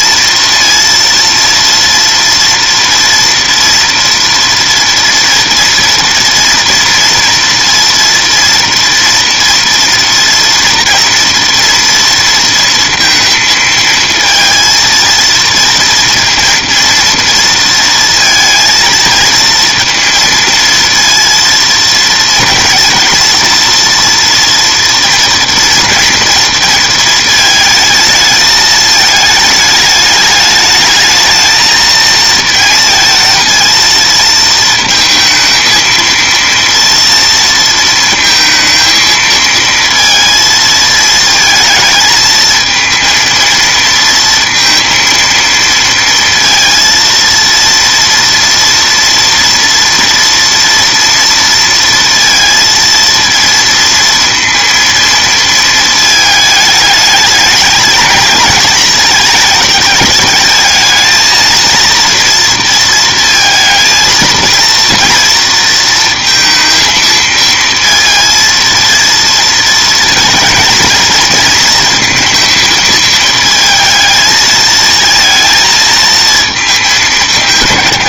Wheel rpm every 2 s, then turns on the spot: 230, 230, 230, 230, 230, 230, 230, 230, 230, 230, 230, 230, 230, 230, 220, 220, 230, 230, 230, 220, 220, 230, 230, 230, 230, 230, 230, 230, 210, 230, 220, 230, 230, 230, 230, 220, 220, 230, 210.
none